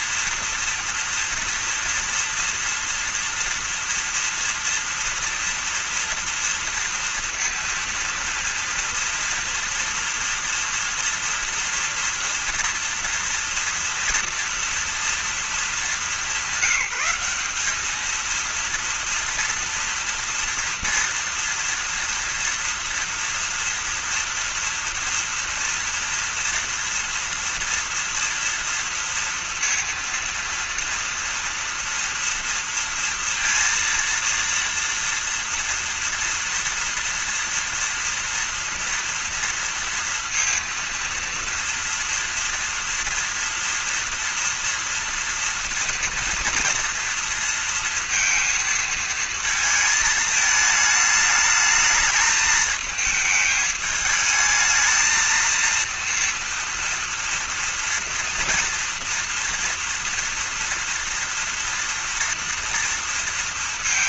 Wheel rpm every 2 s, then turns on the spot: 230, 230, 230, 230, 230, 230, 230, 230, 200, 220, 230, 230, 230, 230, 230, 230, 230, 230, 230, 230, 230, 230, 230, 230, 230, 220, 210, 220, 230, 230, 230, 230.
none